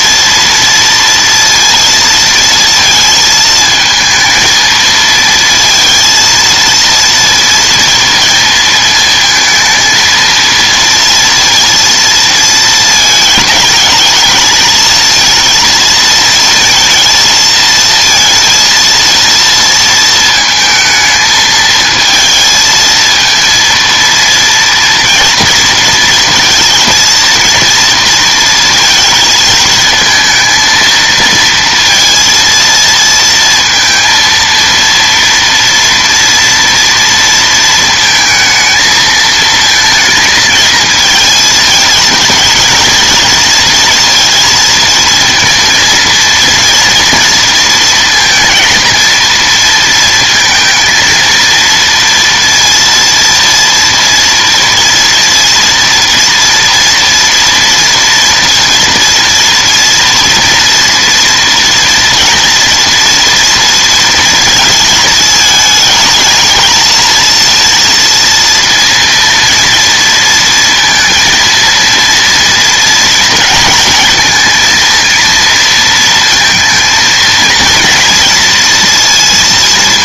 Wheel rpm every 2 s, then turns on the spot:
230, 230, 220, 230, 230, 230, 220, 230, 230, 230, 220, 220, 230, 230, 230, 220, 230, 230, 230, 220, 220, 220, 230, 230, 230, 230, 230, 230, 240, 230, 230, 230, 220, 220, 230, 230, 230, 230, 230, 230.
none